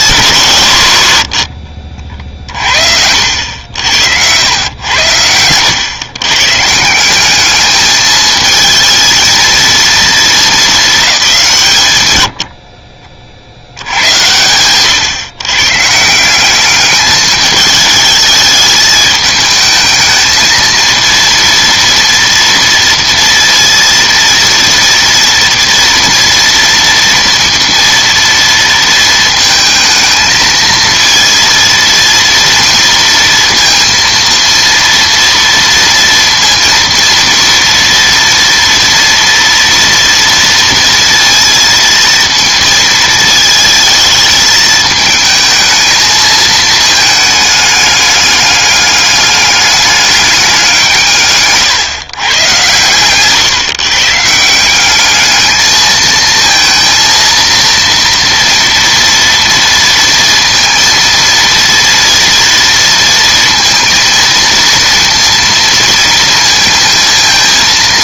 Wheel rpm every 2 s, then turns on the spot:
90, 60, 100, 160, 220, 200, 40, 120, 210, 210, 230, 230, 230, 230, 230, 230, 230, 230, 230, 230, 230, 220, 220, 220, 210, 170, 120, 190, 230, 230, 230, 230, 230, 230.
none